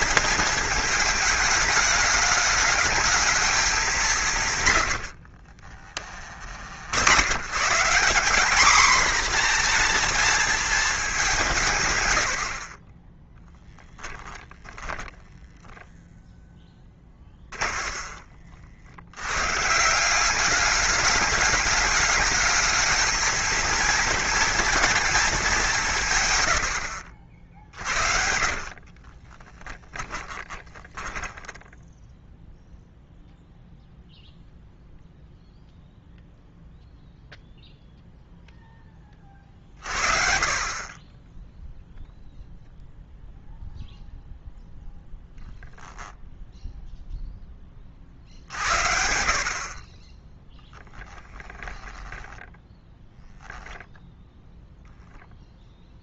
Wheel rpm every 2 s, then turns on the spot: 220, 220, 100, 80, 230, 220, 40, 20, 10, 60, 200, 220, 230, 90, 40, 20, 0, 0, 0, 10, 20, 0, 0, 0, 60, 10, 10, 0.
14-18 28-32 50-54